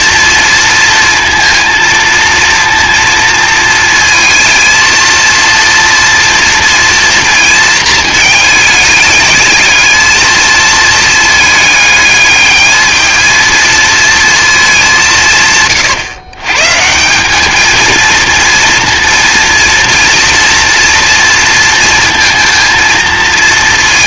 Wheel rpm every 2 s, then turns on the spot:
230, 230, 230, 230, 210, 220, 220, 200, 150, 230, 230, 220.
none